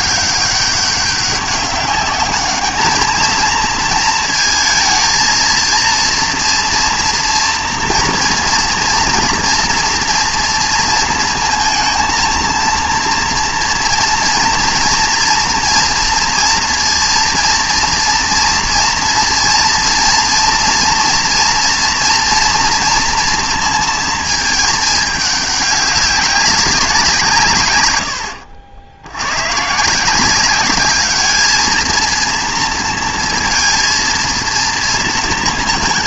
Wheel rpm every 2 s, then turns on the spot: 200, 220, 230, 230, 230, 230, 230, 230, 230, 230, 230, 230, 220, 190, 90, 200, 230, 230.
none